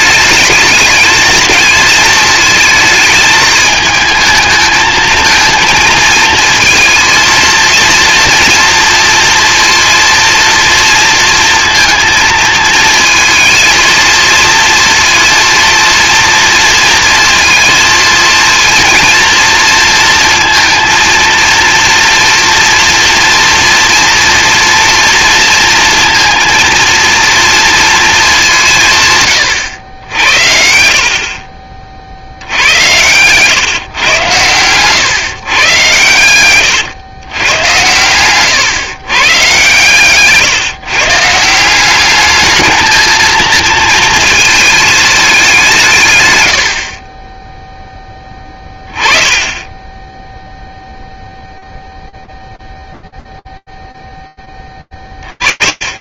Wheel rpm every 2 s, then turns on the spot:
220, 220, 220, 220, 230, 230, 220, 230, 230, 230, 230, 230, 230, 230, 180, 60, 80, 120, 120, 120, 150, 220, 220, 90, 20, 0, 0, 40.
none